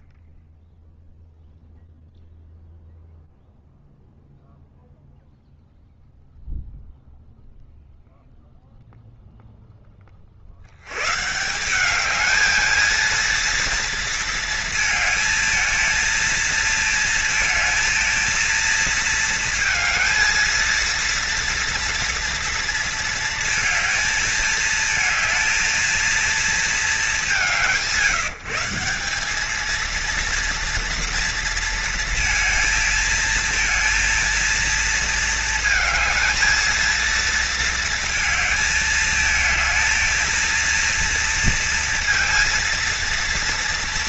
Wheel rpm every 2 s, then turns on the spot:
0, 0, 0, 0, 0, 80, 220, 230, 230, 230, 230, 230, 220, 190, 170, 230, 220, 230, 230, 220, 230, 230.
none